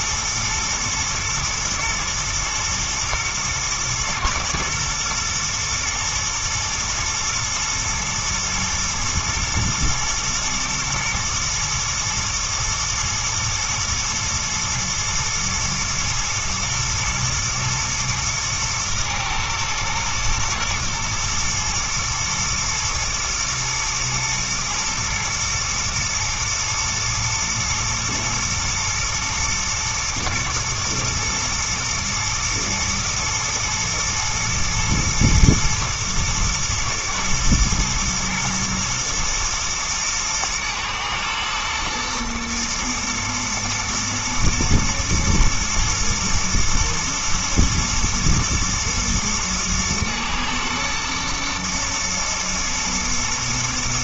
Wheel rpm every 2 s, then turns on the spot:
110, 110, 120, 120, 110, 110, 110, 110, 110, 110, 120, 120, 120, 110, 110, 120, 120, 120, 110, 110, 110, 110, 120, 110, 110, 110, 110.
none